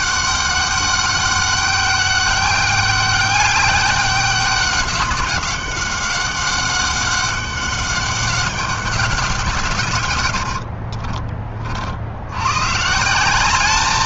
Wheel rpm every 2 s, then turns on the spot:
200, 200, 200, 190, 200, 80, 110.
10-12